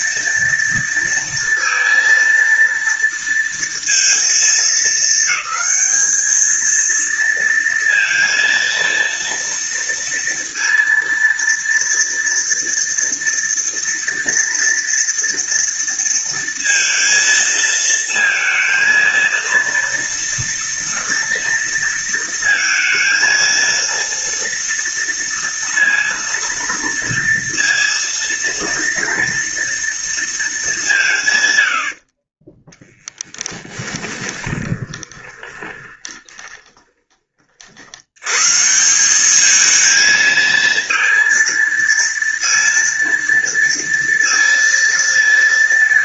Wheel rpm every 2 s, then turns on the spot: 230, 230, 220, 230, 230, 230, 230, 230, 230, 230, 230, 230, 230, 230, 230, 180, 10, 20, 30, 170, 230, 230, 230.
32-36